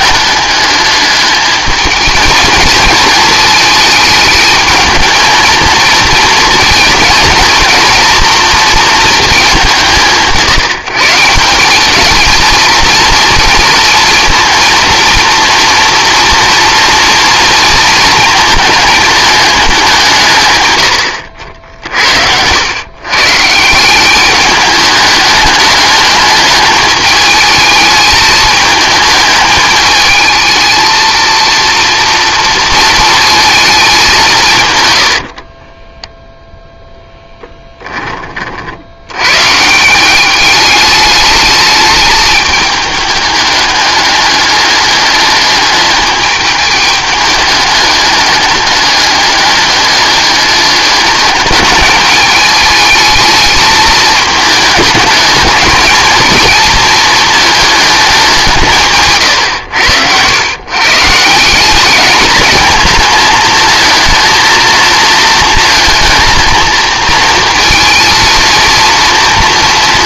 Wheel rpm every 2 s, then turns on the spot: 210, 220, 220, 230, 230, 160, 230, 230, 230, 220, 110, 100, 210, 210, 220, 220, 230, 130, 0, 50, 200, 210, 200, 210, 210, 210, 210, 220, 230, 170, 120, 220, 230, 220, 230.
none